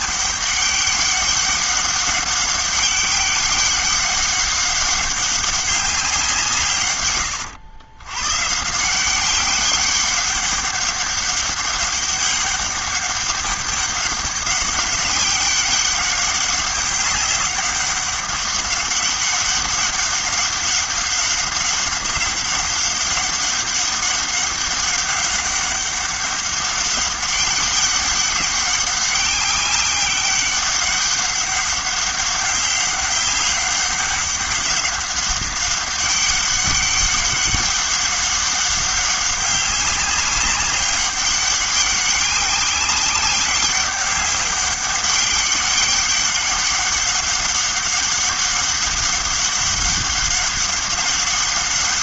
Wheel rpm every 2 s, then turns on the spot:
200, 200, 200, 150, 150, 200, 200, 200, 200, 200, 200, 200, 200, 200, 200, 200, 200, 200, 200, 200, 200, 200, 200, 200, 200, 200.
none